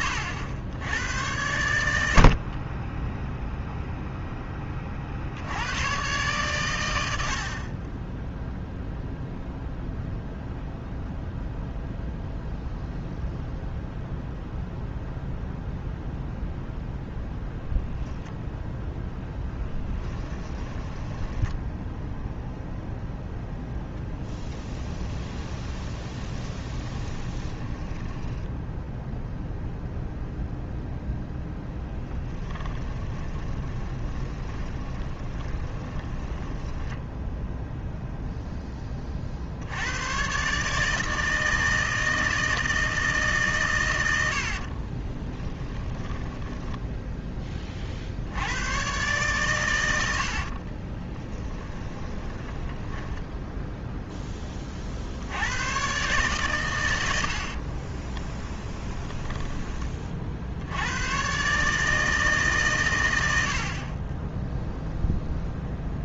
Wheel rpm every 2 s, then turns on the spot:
90, 20, 40, 100, 0, 0, 0, 0, 0, 0, 10, 0, 20, 20, 0, 0, 20, 20, 10, 20, 150, 160, 50, 10, 120, 30, 10, 40, 110, 10, 100, 120, 0.
20-22 24-28 32-36 44-48 50-54 58-60